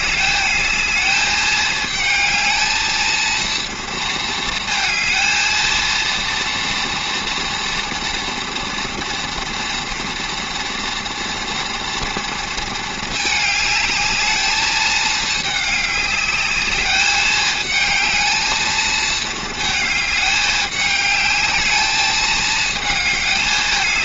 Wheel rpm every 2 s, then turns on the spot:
210, 220, 220, 230, 230, 230, 220, 210, 200, 220, 210, 220.
none